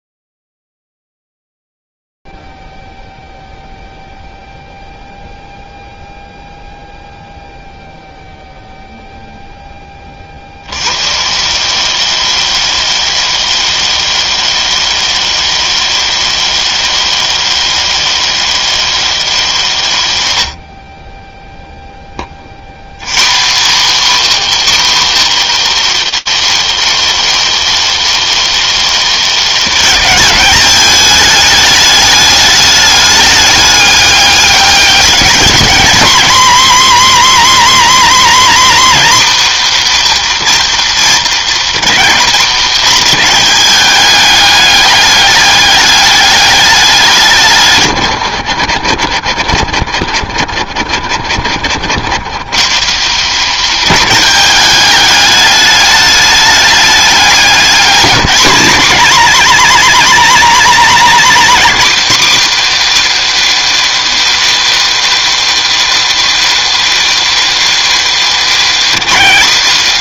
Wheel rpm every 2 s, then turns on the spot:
10, 0, 0, 0, 0, 40, 160, 160, 160, 160, 60, 110, 260, 210, 210, 210, 210, 200, 210, 220, 230, 220, 200, 200, 70, 50, 140, 200, 210, 200, 200, 290, 300, 300, 270.
none